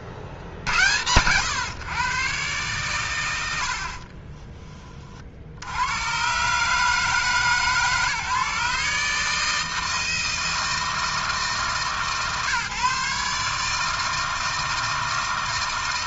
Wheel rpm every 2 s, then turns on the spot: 100, 110, 30, 150, 150, 160, 150, 160.
none